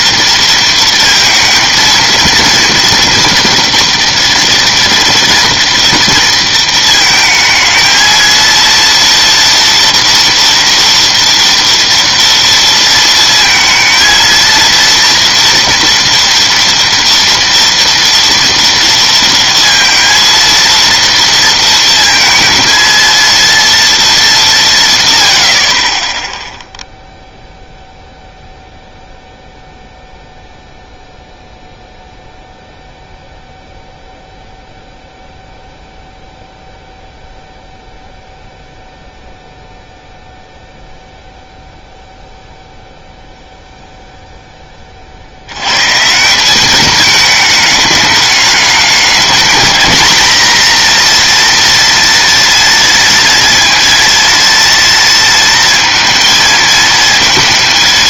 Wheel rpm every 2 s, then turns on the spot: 230, 230, 230, 230, 230, 230, 230, 230, 230, 230, 230, 230, 200, 0, 0, 0, 0, 0, 0, 0, 0, 0, 10, 190, 210, 240, 230, 230, 230.
none